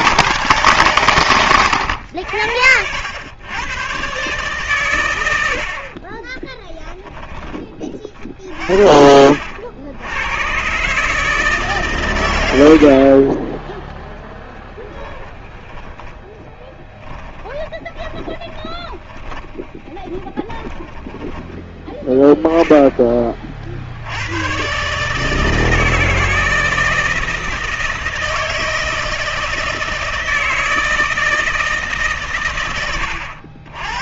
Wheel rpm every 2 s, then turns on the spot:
110, 80, 130, 20, 50, 120, 80, 10, 10, 20, 20, 20, 130, 160, 160, 160, 110.
6-8 14-22